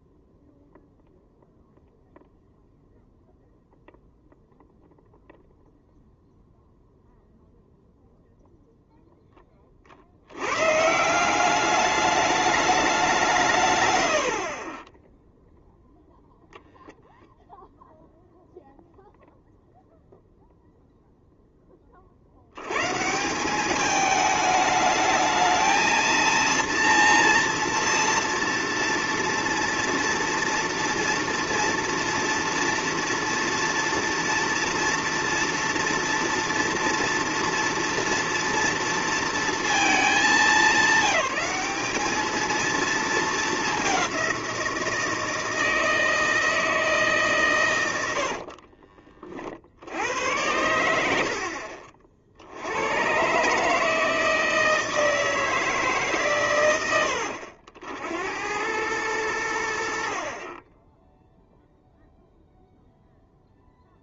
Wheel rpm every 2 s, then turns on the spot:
0, 0, 0, 0, 0, 120, 210, 40, 0, 0, 0, 90, 210, 230, 230, 230, 230, 230, 230, 230, 190, 230, 170, 160, 50, 80, 80, 160, 100, 90, 30, 0.
14-16 48-50